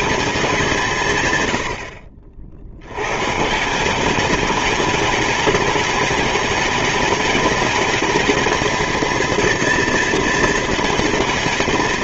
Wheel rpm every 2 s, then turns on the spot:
130, 110, 210, 210, 230, 220.
none